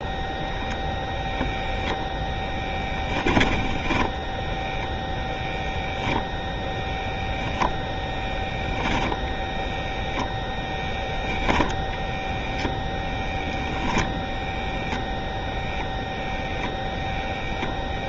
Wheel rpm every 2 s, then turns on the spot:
0, 10, 0, 0, 0, 0, 0, 0, 0.
none